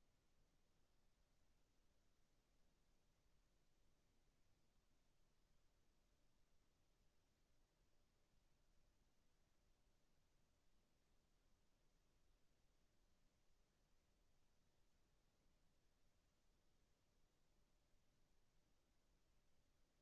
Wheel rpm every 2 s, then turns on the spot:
0, 0, 0, 0, 0, 0, 0, 0, 0, 0.
none